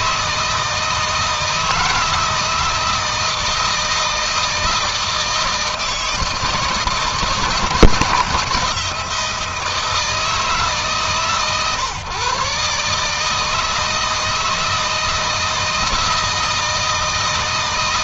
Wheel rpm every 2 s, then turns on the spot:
160, 160, 160, 160, 160, 160, 140, 160, 160.
none